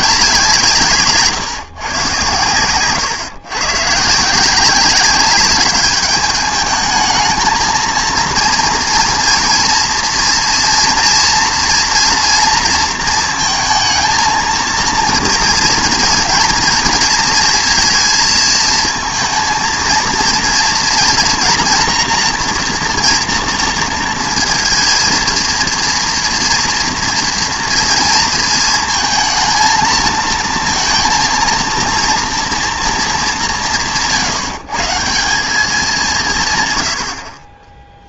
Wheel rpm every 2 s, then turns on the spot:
180, 120, 160, 210, 230, 240, 230, 230, 230, 230, 230, 240, 230, 240, 230, 230, 240, 160, 150.
none